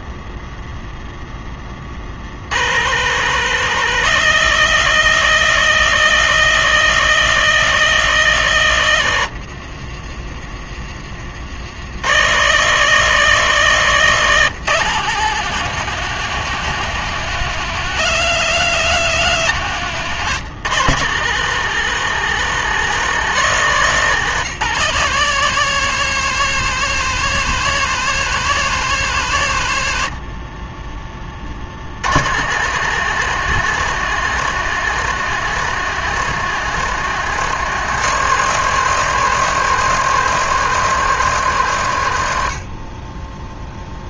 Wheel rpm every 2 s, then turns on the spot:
10, 150, 170, 170, 90, 50, 170, 170, 180, 180, 160, 170, 180, 180, 160, 30, 160, 160, 160, 150, 150, 30.
8-10